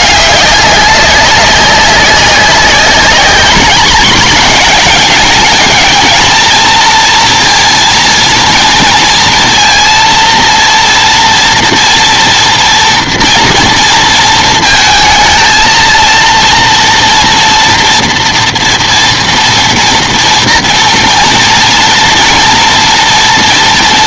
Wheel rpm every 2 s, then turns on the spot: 190, 200, 220, 230, 230, 230, 230, 220, 230, 230, 230, 230.
none